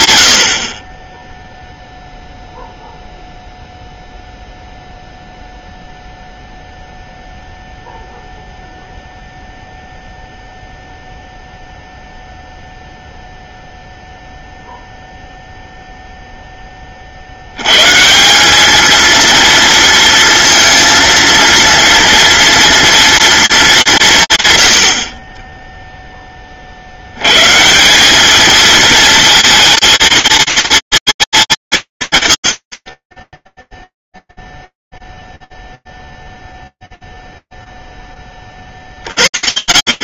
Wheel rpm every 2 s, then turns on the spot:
40, 0, 0, 0, 0, 0, 0, 0, 20, 210, 230, 230, 90, 60, 220, 230, 80, 0, 0, 40.
none